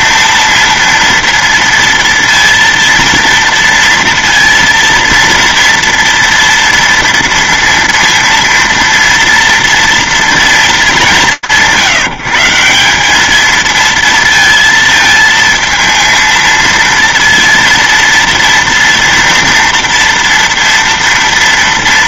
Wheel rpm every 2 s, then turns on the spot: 230, 230, 230, 230, 230, 220, 150, 230, 230, 230, 230.
none